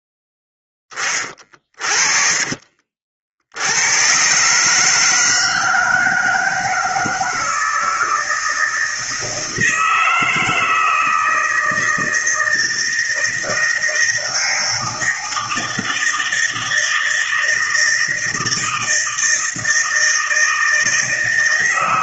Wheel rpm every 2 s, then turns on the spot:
10, 50, 130, 160, 160, 160, 160, 160, 160, 160, 160.
2-4